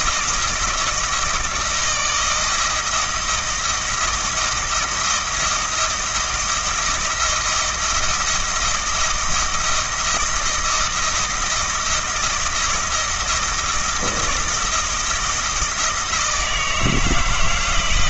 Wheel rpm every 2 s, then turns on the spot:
170, 160, 160, 160, 160, 160, 170, 160, 160.
none